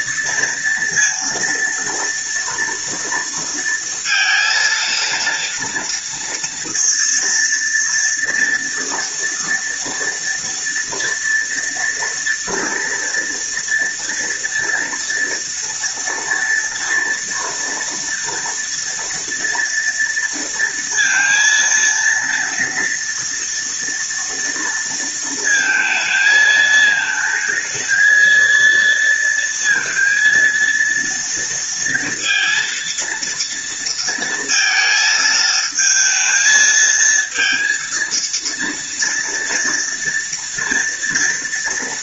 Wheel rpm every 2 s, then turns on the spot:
230, 230, 230, 230, 230, 230, 230, 240, 240, 230, 230, 230, 230, 220, 230, 230, 230, 220, 230, 230, 230.
none